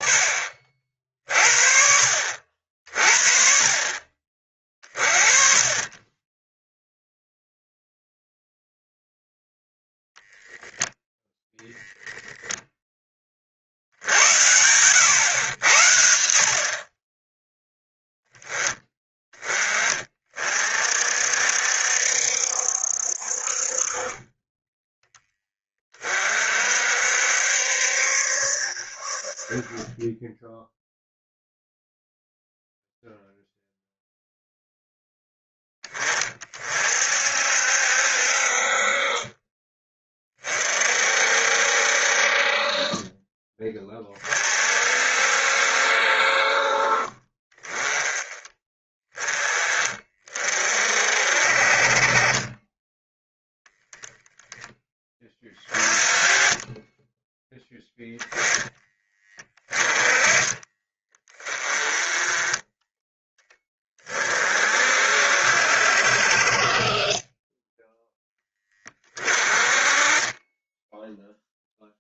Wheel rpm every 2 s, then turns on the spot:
50, 50, 40, 0, 0, 0, 20, 90, 30, 20, 50, 60, 10, 60, 50, 0, 0, 0, 50, 40, 50, 30, 50, 40, 20, 50, 10, 10, 20, 20, 20, 10, 50, 30, 20, 10.
none